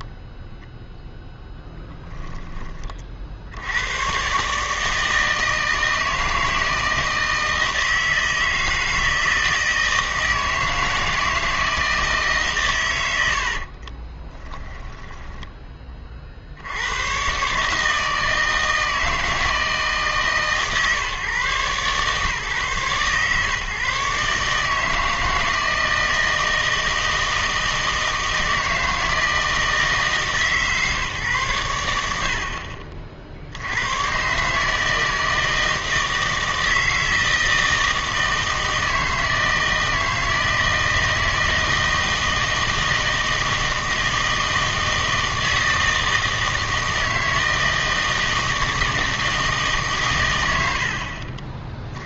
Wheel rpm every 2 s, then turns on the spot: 0, 20, 150, 160, 160, 160, 130, 10, 90, 160, 140, 140, 150, 160, 160, 150, 50, 150, 160, 160, 160, 160, 160, 160, 160, 70.
14-16 32-34